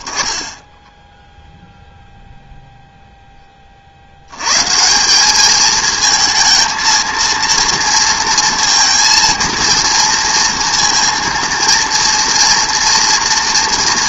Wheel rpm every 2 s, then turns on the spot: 10, 0, 150, 230, 230, 230, 230.
none